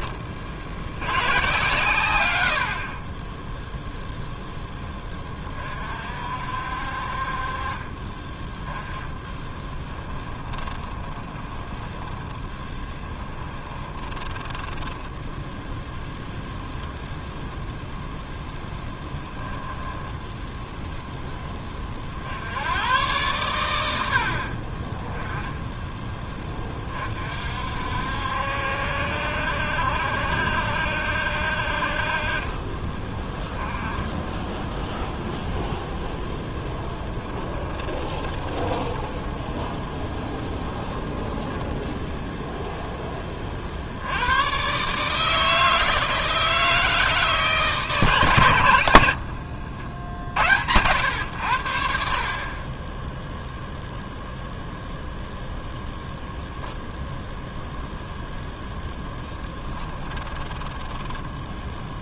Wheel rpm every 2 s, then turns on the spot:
50, 20, 10, 50, 10, 20, 10, 10, 0, 0, 0, 110, 30, 30, 70, 70, 20, 0, 10, 10, 10, 10, 140, 160, 90, 90, 20, 0, 0, 0, 10.
10-16 32-34 36-40